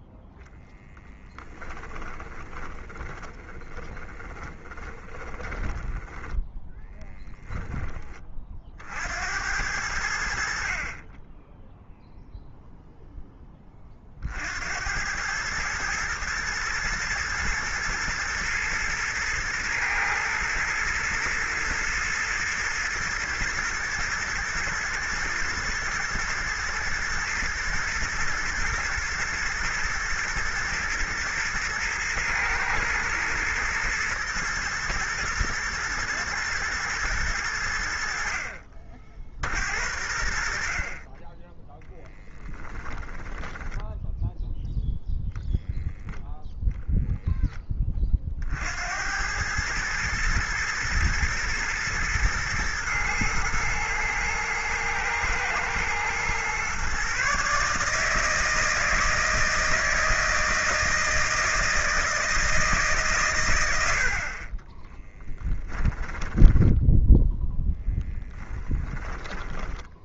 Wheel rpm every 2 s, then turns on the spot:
10, 20, 20, 10, 60, 40, 0, 80, 110, 110, 110, 110, 110, 110, 110, 110, 110, 120, 120, 50, 40, 10, 0, 0, 70, 110, 110, 110, 130, 160, 160, 150, 20, 10, 10.
0-8 42-44 64-70